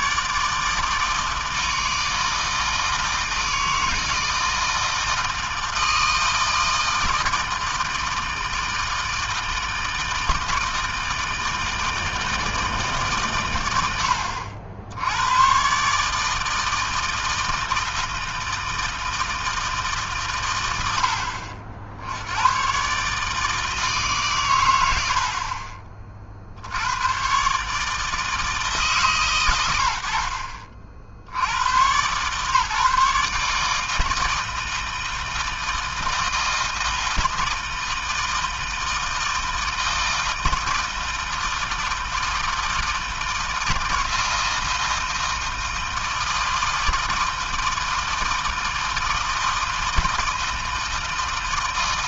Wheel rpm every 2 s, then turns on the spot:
160, 160, 160, 160, 160, 160, 130, 90, 160, 160, 70, 150, 70, 110, 140, 70, 150, 160, 160, 160, 160, 160, 160, 160, 160, 160.
24-26